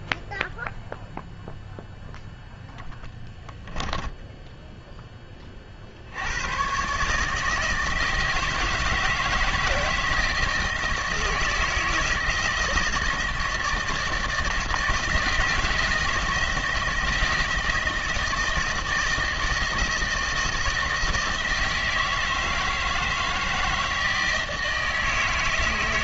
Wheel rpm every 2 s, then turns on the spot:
0, 0, 10, 120, 160, 160, 160, 160, 160, 160, 160, 160, 160.
4-6